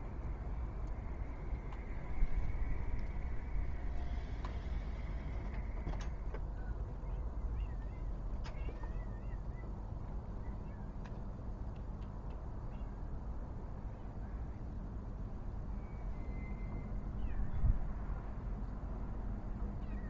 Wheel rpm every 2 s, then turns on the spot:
0, 0, 0, 0, 0, 0, 0, 0, 0, 0.
none